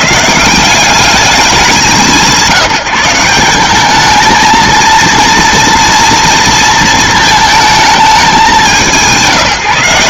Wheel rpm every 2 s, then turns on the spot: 160, 160, 220, 230, 190.
none